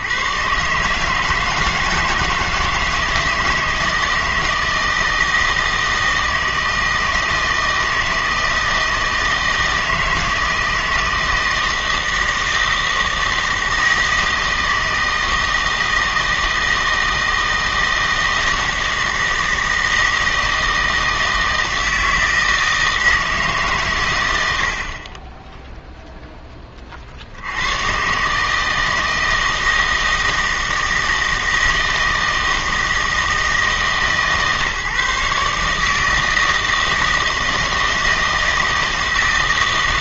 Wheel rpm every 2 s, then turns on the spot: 140, 160, 160, 160, 160, 160, 160, 160, 160, 160, 160, 160, 70, 20, 160, 160, 160, 150, 160, 160.
none